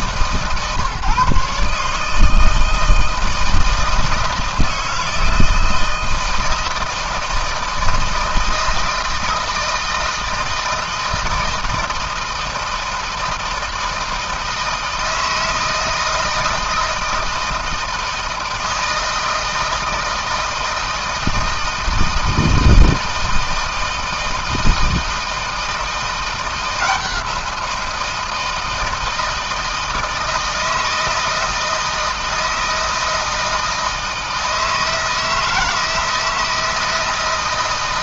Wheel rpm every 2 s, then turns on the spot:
140, 160, 160, 160, 160, 160, 160, 160, 160, 160, 160, 160, 170, 170, 160, 160, 160, 160, 160.
none